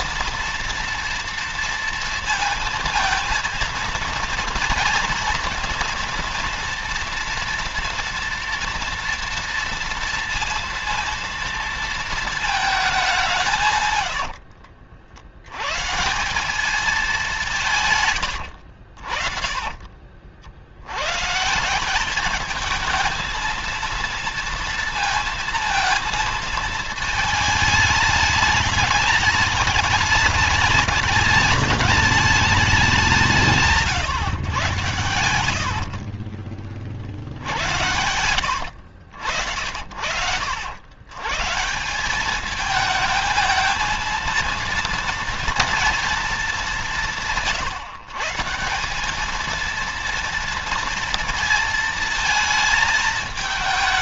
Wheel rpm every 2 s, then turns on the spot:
230, 230, 230, 230, 230, 230, 210, 80, 190, 60, 90, 220, 230, 220, 210, 210, 200, 130, 40, 80, 100, 220, 230, 200, 190, 230, 220.
none